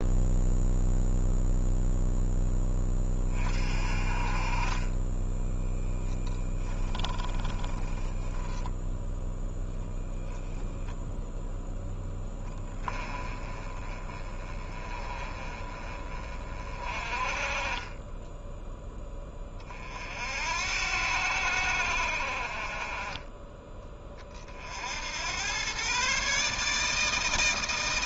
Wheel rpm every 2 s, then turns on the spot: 0, 10, 30, 10, 0, 0, 10, 20, 40, 10, 70, 40, 50, 150.
4-8